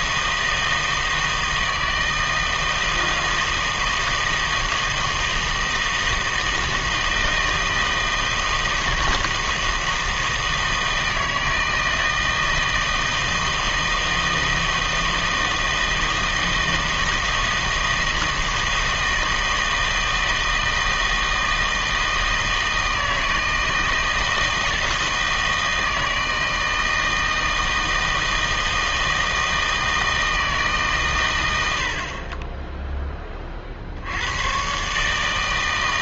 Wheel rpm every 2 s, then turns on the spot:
160, 160, 160, 160, 160, 160, 160, 160, 160, 160, 160, 160, 160, 160, 160, 150, 10, 120.
none